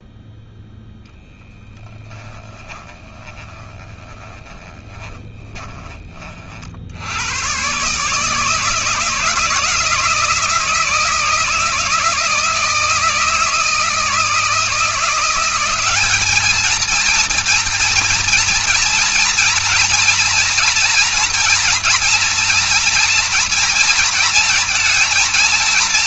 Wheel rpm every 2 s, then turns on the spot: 0, 20, 20, 80, 160, 160, 160, 170, 230, 230, 230, 230, 230.
2-6